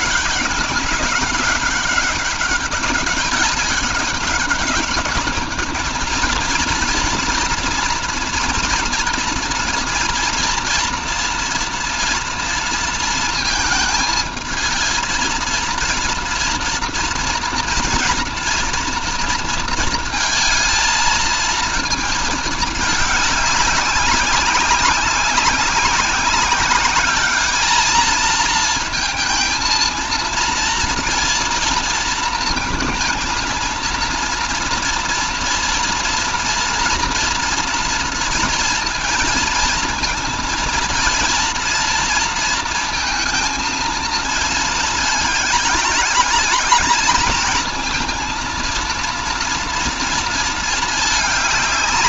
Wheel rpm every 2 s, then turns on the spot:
200, 200, 210, 230, 230, 230, 230, 220, 230, 230, 220, 210, 200, 200, 230, 230, 230, 230, 230, 230, 230, 230, 220, 220, 230, 220.
none